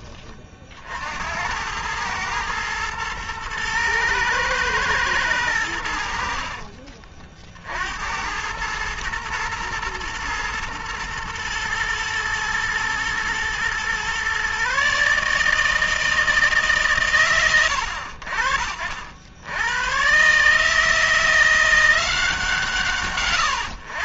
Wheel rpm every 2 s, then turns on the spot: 90, 110, 100, 50, 110, 110, 120, 160, 110, 90, 170, 140.
none